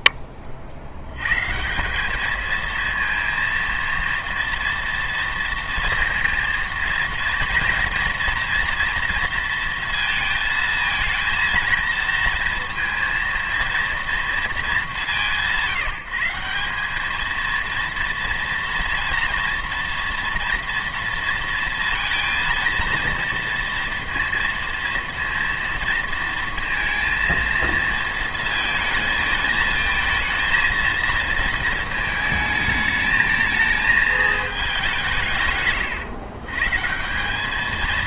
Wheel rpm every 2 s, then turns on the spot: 60, 220, 230, 230, 230, 230, 230, 190, 210, 230, 230, 230, 230, 230, 230, 230, 220, 190, 160.
none